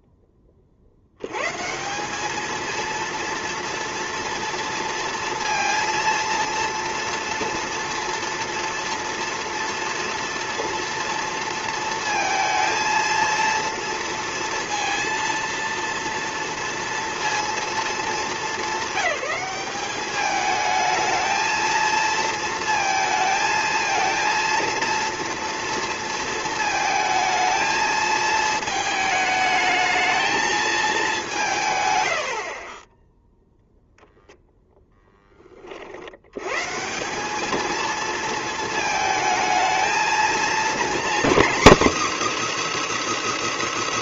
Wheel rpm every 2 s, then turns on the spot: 50, 220, 230, 230, 230, 230, 230, 230, 230, 210, 220, 230, 230, 230, 220, 220, 40, 0, 140, 220, 240, 340.
32-34